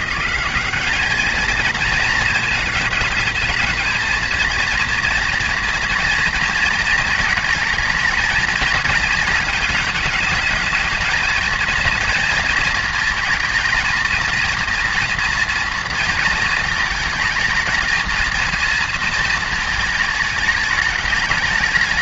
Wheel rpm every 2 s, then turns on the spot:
200, 220, 230, 230, 220, 220, 230, 230, 230, 230, 210.
none